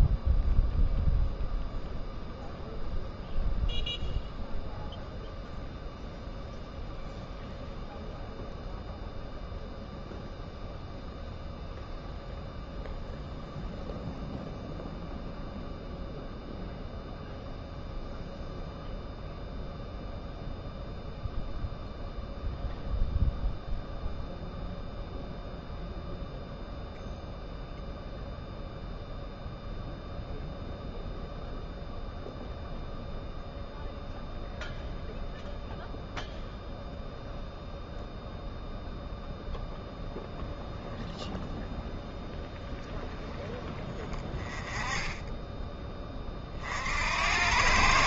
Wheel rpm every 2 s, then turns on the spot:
0, 0, 0, 0, 0, 0, 0, 0, 0, 0, 0, 0, 0, 0, 0, 0, 0, 0, 0, 0, 0, 0, 10, 50.
none